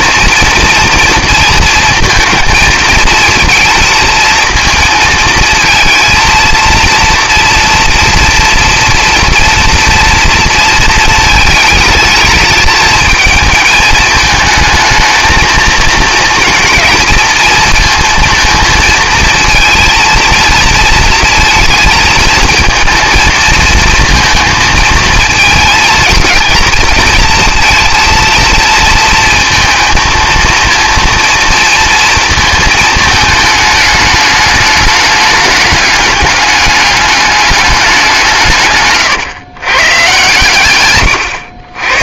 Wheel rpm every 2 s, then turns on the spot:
230, 220, 230, 230, 240, 230, 210, 220, 230, 230, 230, 230, 230, 230, 230, 230, 220, 210, 210, 140, 120.
none